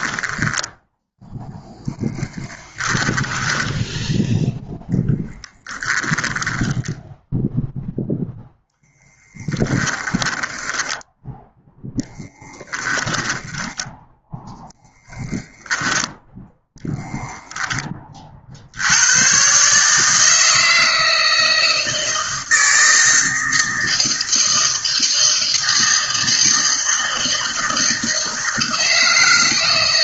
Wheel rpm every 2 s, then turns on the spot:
20, 10, 0, 10, 10, 10, 10, 10, 0, 90, 160, 160, 160, 160, 160.
0-4 10-16